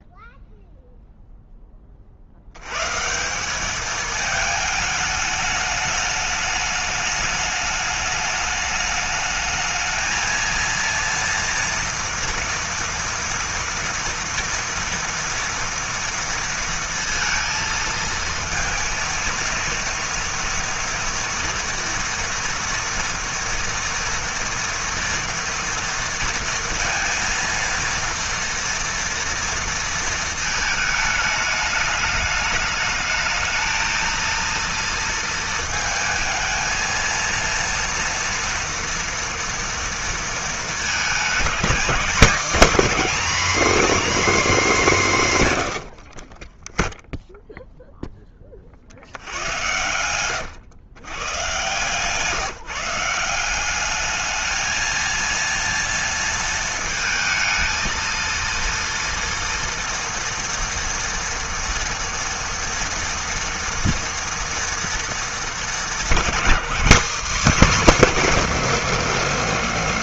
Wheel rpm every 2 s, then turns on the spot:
0, 110, 220, 210, 210, 230, 230, 230, 230, 230, 230, 240, 240, 230, 230, 220, 210, 230, 230, 230, 220, 270, 230, 10, 30, 110, 160, 220, 220, 230, 230, 230, 230, 210, 240.
none